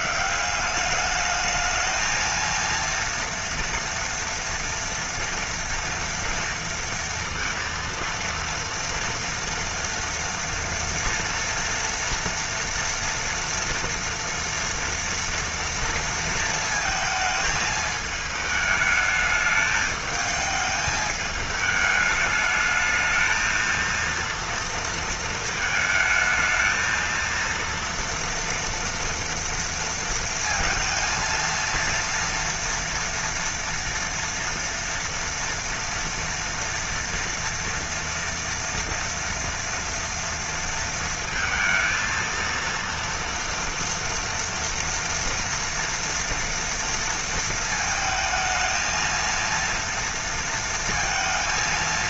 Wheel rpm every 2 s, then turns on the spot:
200, 230, 230, 230, 230, 230, 240, 230, 220, 220, 220, 220, 230, 220, 230, 230, 230, 230, 230, 230, 230, 230, 230, 230, 220, 230.
none